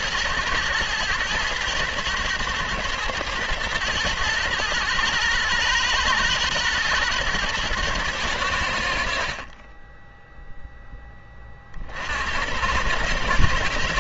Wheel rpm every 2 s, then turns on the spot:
110, 110, 120, 110, 80, 0, 90.
none